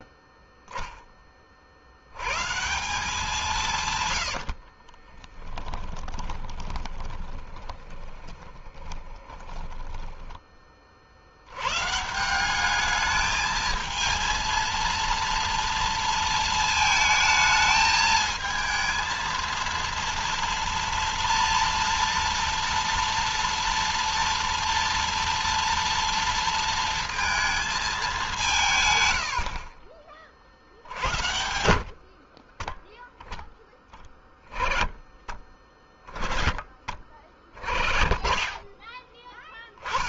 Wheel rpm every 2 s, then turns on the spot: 0, 140, 70, 10, 10, 20, 180, 230, 230, 220, 230, 230, 230, 230, 160, 40, 30, 10, 20, 10.
4-10